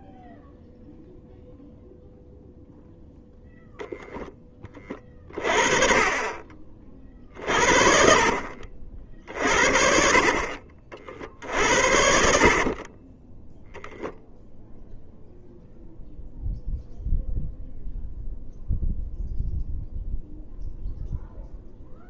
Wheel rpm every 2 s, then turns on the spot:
0, 0, 30, 40, 40, 40, 40, 0, 0, 0, 0.
12-14